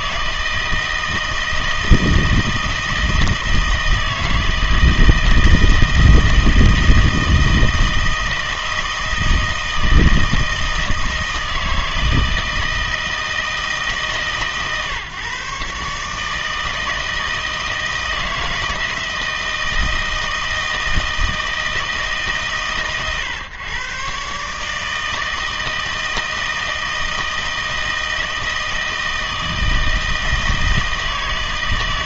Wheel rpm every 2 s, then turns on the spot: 160, 160, 160, 160, 160, 160, 160, 140, 160, 160, 160, 140, 150, 160, 160, 160.
none